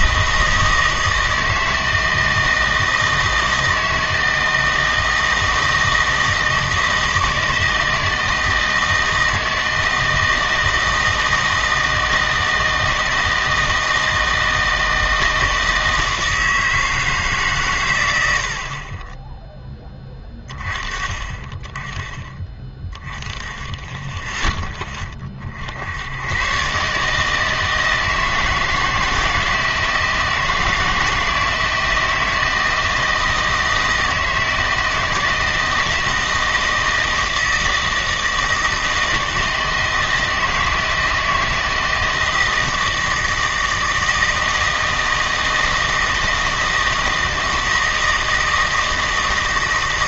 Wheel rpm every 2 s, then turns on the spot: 160, 160, 160, 160, 160, 160, 160, 160, 160, 60, 30, 20, 10, 130, 160, 160, 160, 160, 160, 160, 160, 160, 160, 160, 160.
none